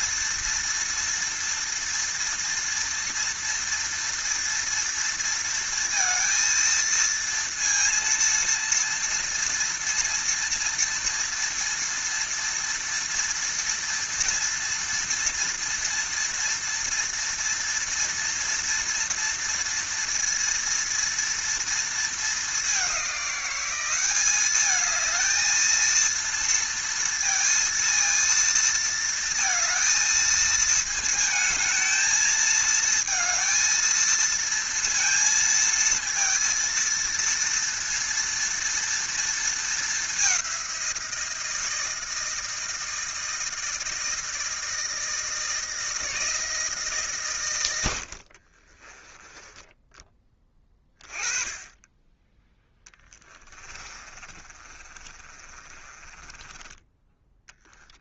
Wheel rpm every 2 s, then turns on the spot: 230, 230, 230, 230, 230, 230, 230, 230, 230, 230, 230, 200, 210, 230, 230, 220, 220, 230, 230, 230, 180, 160, 160, 150, 20, 20, 10, 40, 10.
48-50 52-58